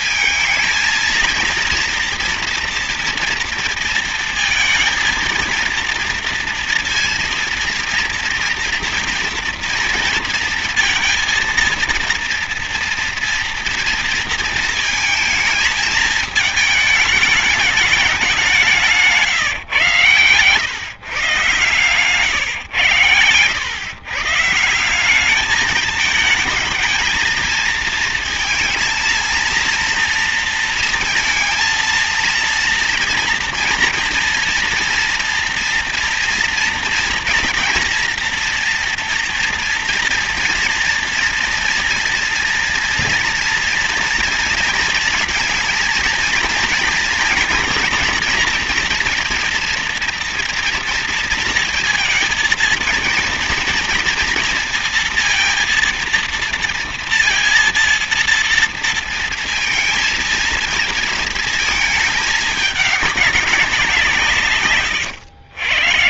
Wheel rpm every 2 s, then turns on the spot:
220, 230, 230, 230, 230, 230, 230, 230, 220, 200, 130, 120, 160, 220, 230, 230, 230, 230, 230, 230, 230, 230, 230, 230, 230, 230, 230, 230, 230, 230, 220, 200, 130.
64-66